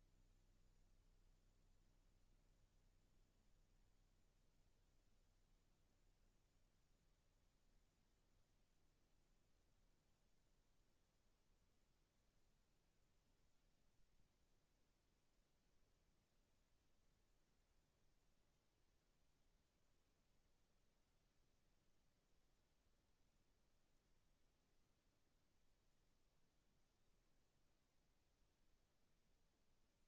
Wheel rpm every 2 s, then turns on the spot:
0, 0, 0, 0, 0, 0, 0, 0, 0, 0, 0, 0, 0, 0, 0.
none